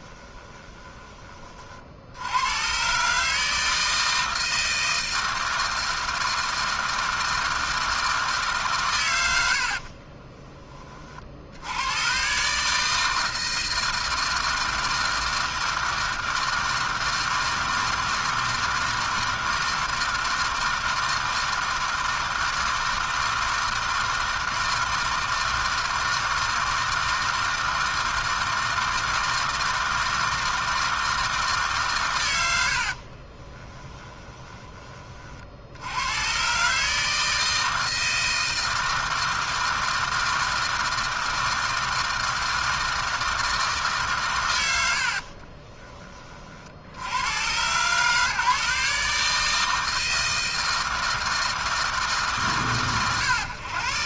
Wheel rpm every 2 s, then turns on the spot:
20, 100, 160, 160, 160, 40, 140, 160, 160, 160, 160, 160, 160, 160, 160, 160, 80, 20, 130, 160, 160, 160, 120, 40, 150, 160, 130.
0-2